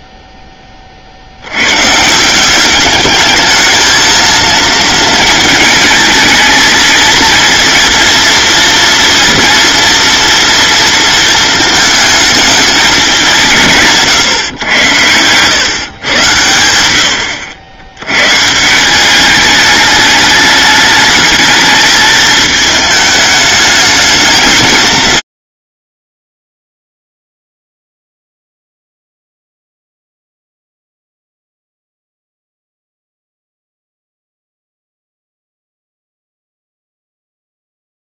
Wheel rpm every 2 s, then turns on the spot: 50, 210, 220, 220, 230, 230, 180, 100, 90, 190, 220, 210, 160, 0, 0, 0, 0, 0, 0.
14-16